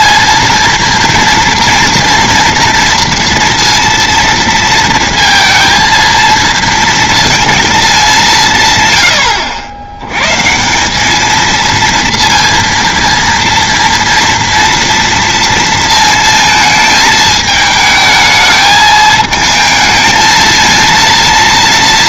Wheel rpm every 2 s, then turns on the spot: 230, 230, 230, 230, 150, 160, 230, 230, 220, 220, 230.
none